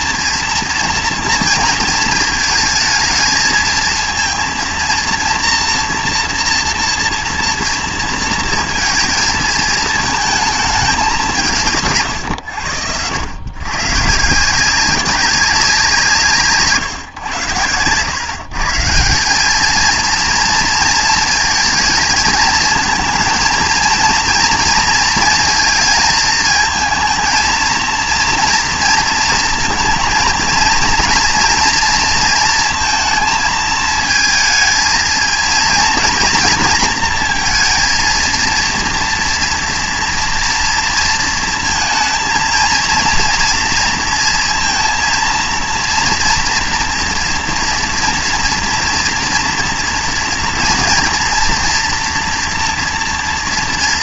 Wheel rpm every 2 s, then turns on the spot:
230, 220, 230, 230, 230, 220, 110, 170, 150, 140, 230, 220, 230, 220, 230, 230, 230, 220, 230, 230, 230, 230, 230, 230, 230, 230, 240.
none